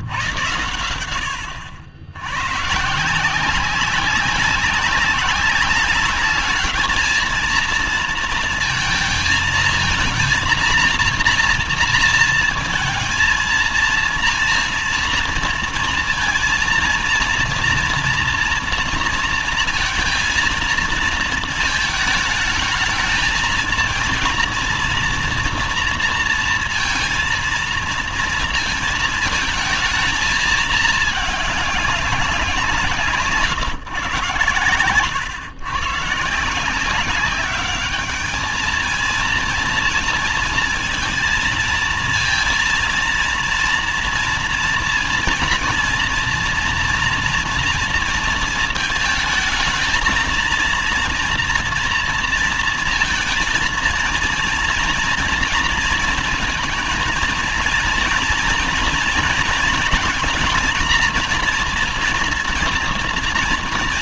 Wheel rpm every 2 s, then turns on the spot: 100, 130, 190, 210, 230, 230, 230, 230, 230, 230, 230, 220, 230, 230, 230, 220, 180, 120, 170, 220, 230, 230, 230, 230, 220, 230, 230, 230, 220, 230, 230, 240.
none